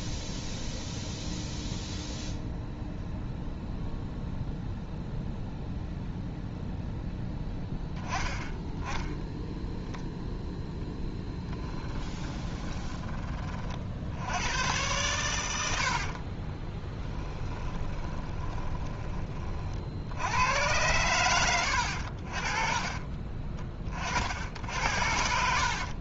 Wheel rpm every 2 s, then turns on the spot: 0, 0, 0, 0, 0, 0, 20, 100, 20, 20, 90, 40, 70.
12-14 16-20 22-24